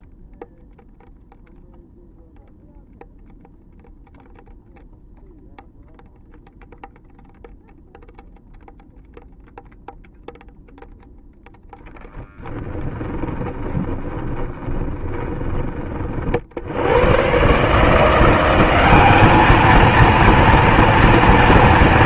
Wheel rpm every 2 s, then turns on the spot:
0, 0, 0, 0, 0, 0, 20, 20, 80, 190, 230.
12-16